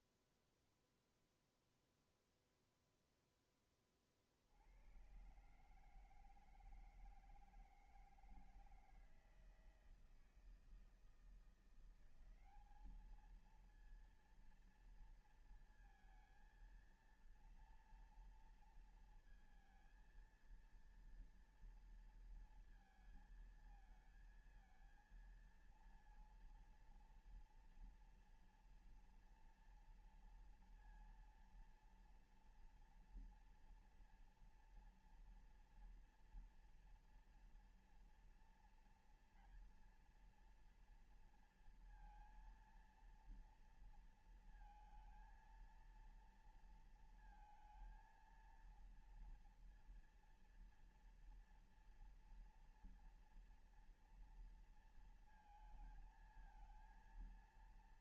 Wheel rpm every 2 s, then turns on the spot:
0, 0, 50, 160, 160, 160, 180, 230, 230, 230, 230, 230, 230, 230, 240, 230, 230, 230, 240, 230, 230, 230, 230, 230, 230, 230, 230, 230, 220.
none